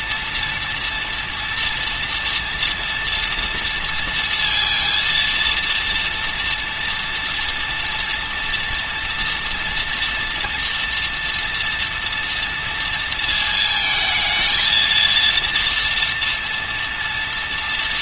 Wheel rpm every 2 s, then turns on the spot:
230, 230, 230, 240, 230, 230, 230, 230, 230.
none